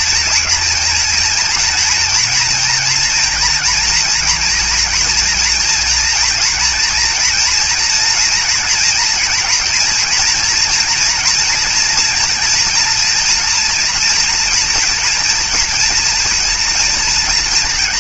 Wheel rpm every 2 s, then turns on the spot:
240, 230, 230, 230, 230, 240, 230, 230, 240.
none